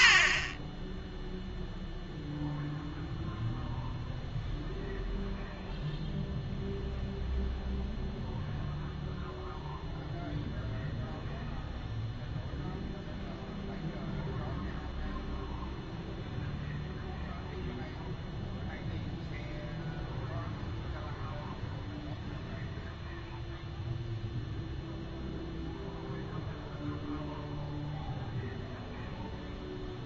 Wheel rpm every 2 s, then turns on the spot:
20, 0, 0, 0, 0, 0, 0, 0, 0, 0, 0, 0, 0, 0, 0.
none